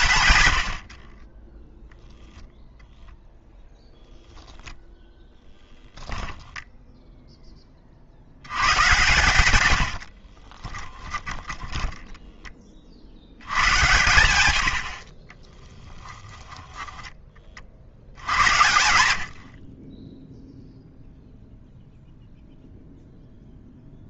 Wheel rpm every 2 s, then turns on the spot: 100, 0, 0, 0, 110, 30, 30, 70, 10, 90, 0, 0.
10-12 16-18